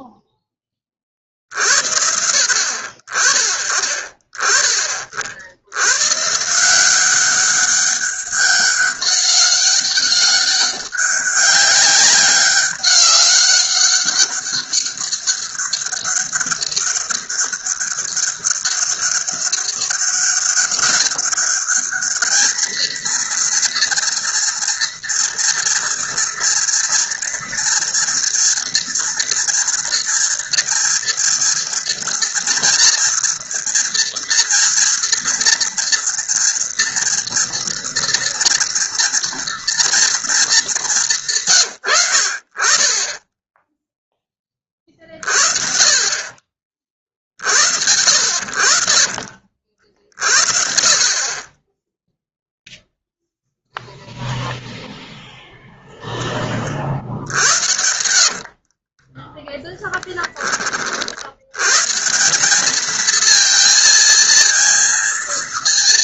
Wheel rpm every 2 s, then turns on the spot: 40, 50, 30, 180, 200, 200, 200, 200, 200, 200, 200, 230, 230, 240, 230, 230, 230, 230, 230, 230, 170, 20, 40, 50, 50, 20, 0, 0, 70, 10, 80, 230, 230.
56-58